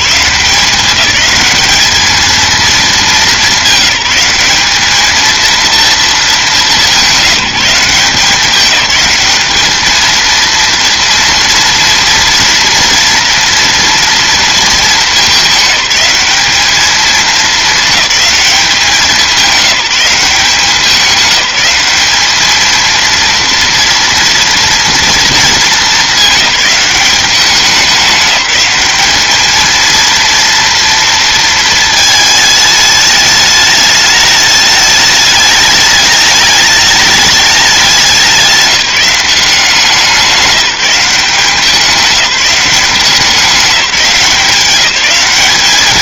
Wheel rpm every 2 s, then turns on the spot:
190, 220, 210, 200, 190, 230, 230, 220, 210, 200, 190, 230, 230, 200, 210, 230, 210, 210, 210, 180, 190, 190, 200.
none